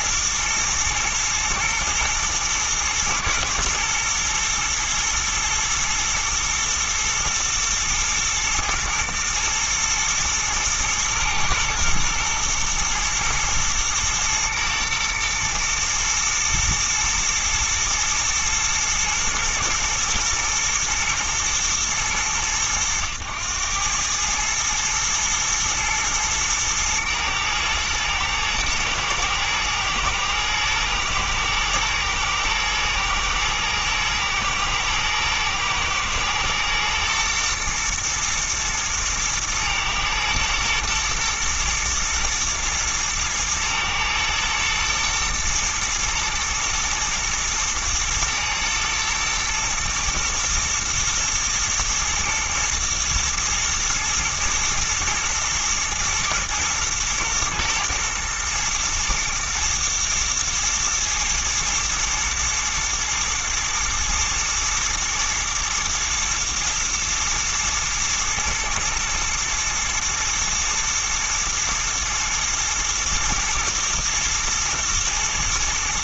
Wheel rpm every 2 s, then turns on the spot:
120, 120, 120, 110, 110, 110, 110, 120, 110, 110, 110, 100, 110, 110, 110, 110, 110, 120, 120, 110, 120, 110, 110, 110, 110, 120, 120, 110, 120, 110, 120, 110, 110, 110, 110, 110, 110, 110.
none